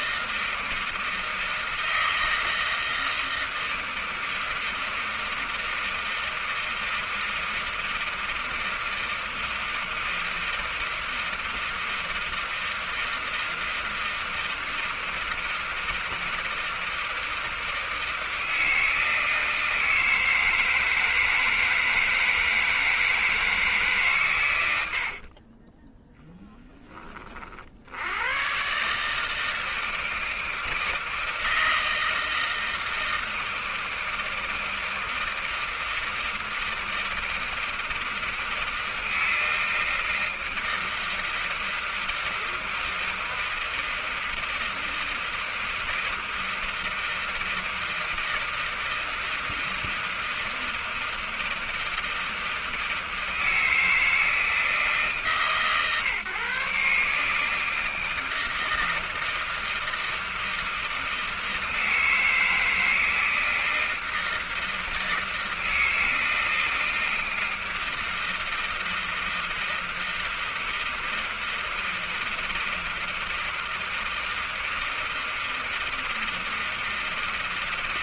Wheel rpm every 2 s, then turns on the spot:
160, 160, 160, 160, 160, 160, 160, 160, 160, 160, 160, 160, 140, 10, 90, 160, 160, 160, 160, 160, 160, 160, 160, 160, 160, 160, 160, 160, 140, 160, 160, 160, 160, 160, 160, 160, 160, 160, 160.
none